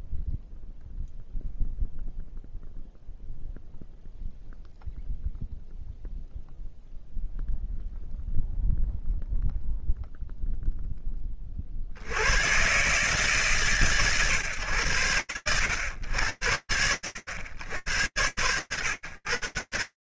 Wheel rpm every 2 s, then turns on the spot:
0, 0, 0, 0, 0, 40, 130, 120, 90, 90.
none